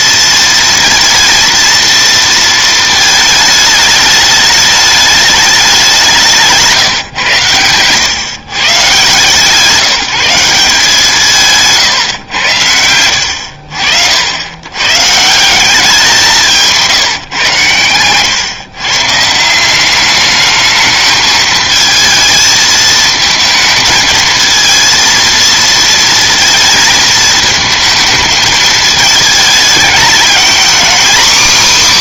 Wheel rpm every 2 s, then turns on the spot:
230, 230, 210, 160, 130, 180, 100, 90, 170, 120, 210, 220, 220, 230, 220, 230.
none